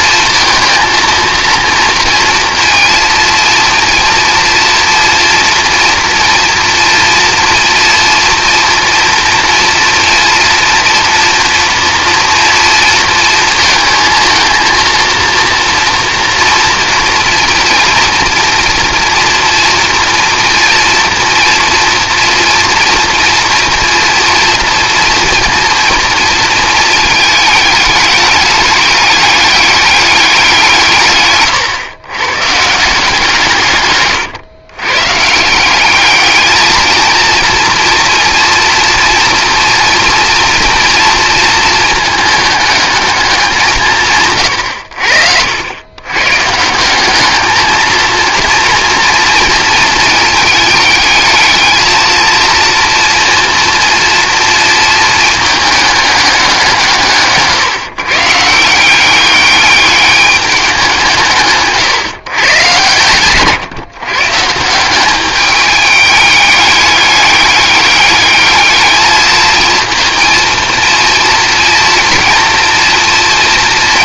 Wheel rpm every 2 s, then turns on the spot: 220, 230, 240, 230, 230, 230, 230, 230, 230, 230, 230, 230, 230, 220, 210, 170, 150, 120, 220, 240, 230, 220, 90, 180, 230, 220, 230, 230, 170, 170, 190, 120, 180, 200, 210, 230, 230.
none